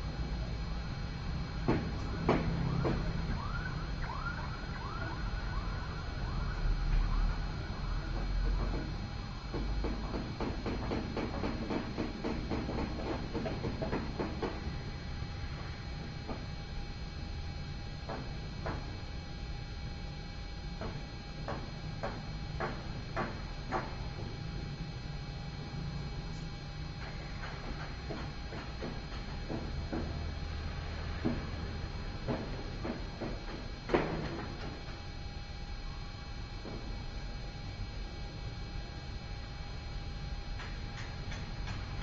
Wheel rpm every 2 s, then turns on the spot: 0, 0, 0, 0, 0, 0, 0, 0, 0, 0, 0, 0, 0, 0, 0, 0, 0, 0, 0, 0, 0.
none